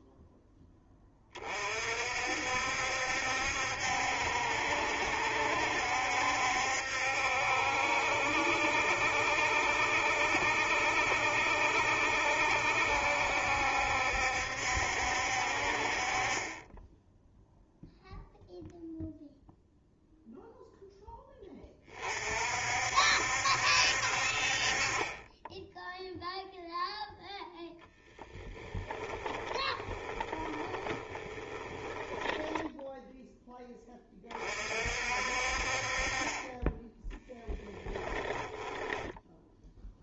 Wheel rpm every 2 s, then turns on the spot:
20, 70, 70, 70, 70, 70, 70, 70, 10, 0, 0, 60, 30, 0, 20, 20, 0, 50, 10, 10.
28-32 38-40